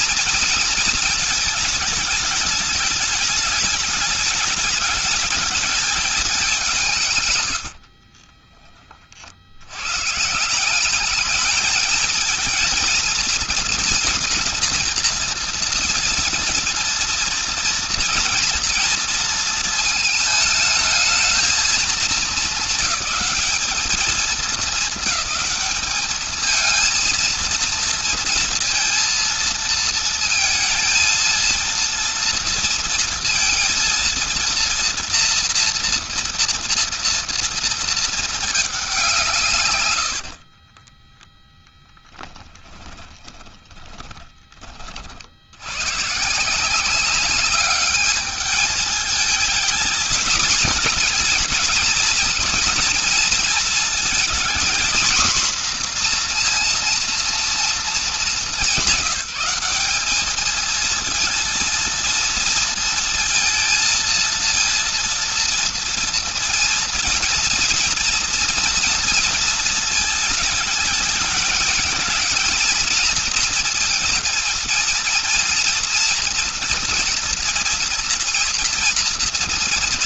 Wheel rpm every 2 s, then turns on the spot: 230, 210, 210, 170, 20, 180, 220, 230, 230, 230, 220, 220, 210, 220, 230, 230, 230, 230, 230, 220, 40, 10, 30, 160, 210, 230, 230, 240, 240, 200, 220, 230, 230, 230, 240, 220, 230, 230, 240, 230.
40-44